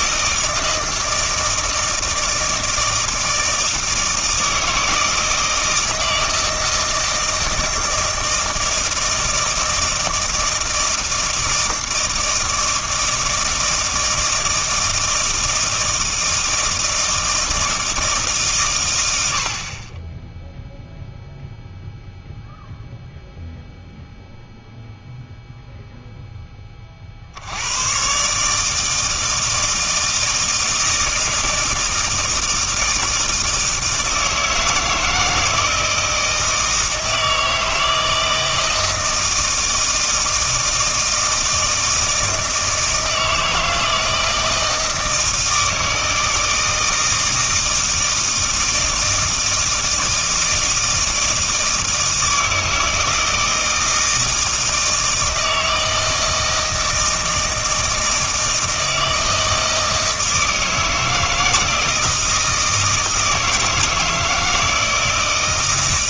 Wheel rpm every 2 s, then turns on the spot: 160, 160, 160, 160, 160, 160, 160, 160, 160, 120, 0, 0, 0, 30, 150, 160, 160, 160, 160, 160, 160, 160, 160, 160, 160, 160, 160, 160, 160, 160, 160, 160, 160.
none